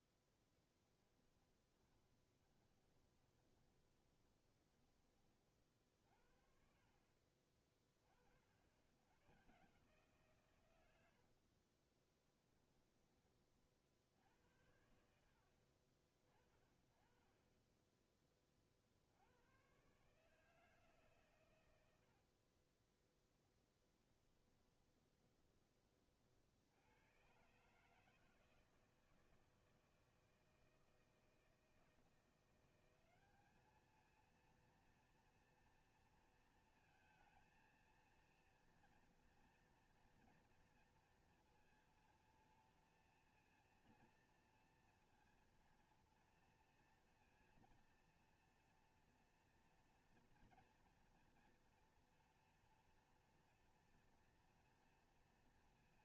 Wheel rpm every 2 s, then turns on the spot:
10, 30, 30, 40, 60, 130, 10, 80, 30, 30, 150, 40, 20, 70, 160, 160, 180, 230, 230, 230, 230, 230, 230, 230, 230, 230, 230, 230.
0-6 22-26